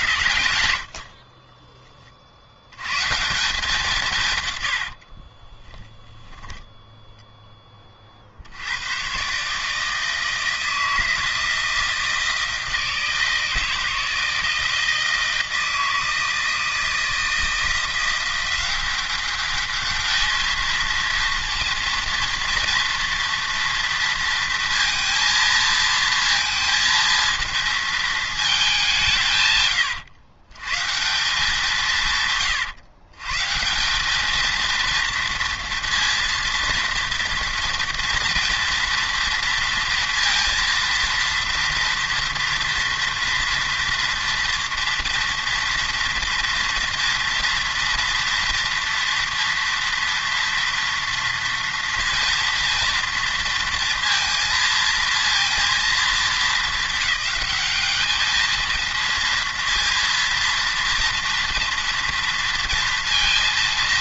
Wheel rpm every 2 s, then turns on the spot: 50, 120, 70, 0, 100, 160, 160, 160, 160, 190, 230, 230, 230, 230, 190, 160, 130, 230, 230, 230, 230, 230, 240, 230, 230, 230, 230, 230, 210, 230, 230, 230.
4-6